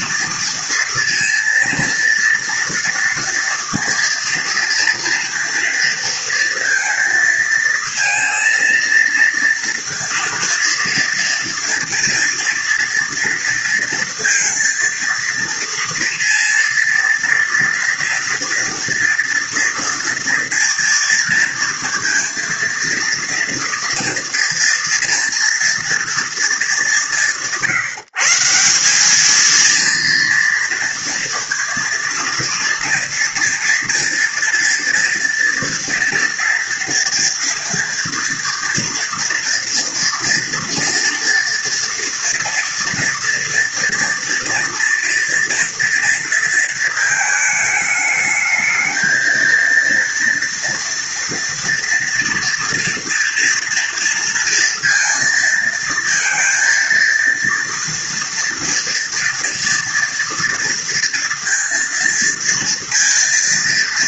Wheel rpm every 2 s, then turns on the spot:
230, 230, 230, 230, 230, 230, 240, 230, 230, 230, 230, 230, 230, 200, 180, 230, 230, 230, 230, 230, 230, 230, 240, 230, 220, 230, 230, 230, 230, 230, 230, 230.
none